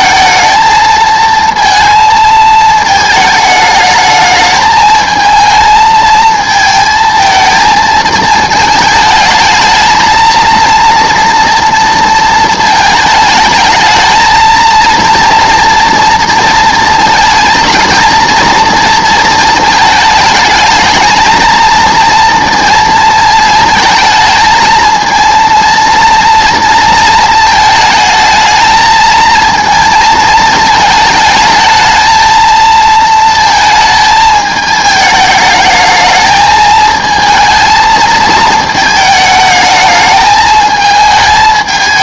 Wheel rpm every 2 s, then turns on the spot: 220, 220, 220, 230, 220, 230, 230, 230, 230, 230, 220, 230, 220, 230, 220, 220, 220, 220, 220, 220, 220.
none